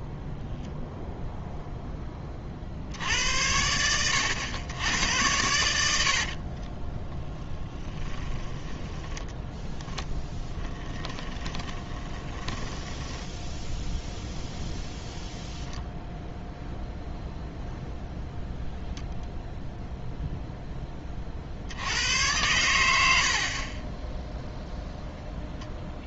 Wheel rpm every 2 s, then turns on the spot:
0, 20, 110, 30, 20, 20, 10, 10, 0, 0, 10, 80, 0.
6-14